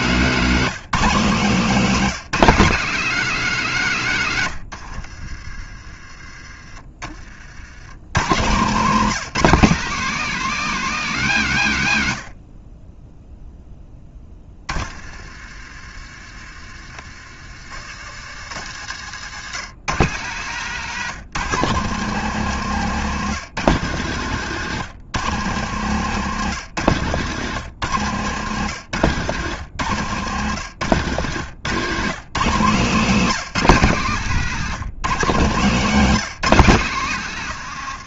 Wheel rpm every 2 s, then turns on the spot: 210, 200, 80, 30, 170, 230, 40, 30, 50, 90, 140, 140, 130, 120, 120, 120, 160, 160, 160.
4-6 18-20